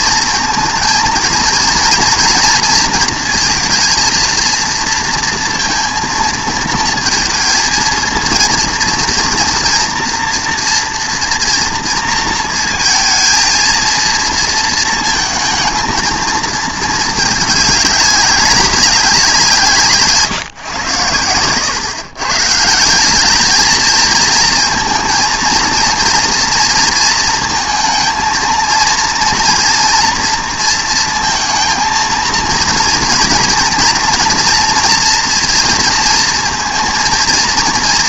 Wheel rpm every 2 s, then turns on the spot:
230, 230, 230, 230, 230, 230, 230, 230, 220, 200, 110, 190, 220, 230, 230, 230, 230, 240, 230.
none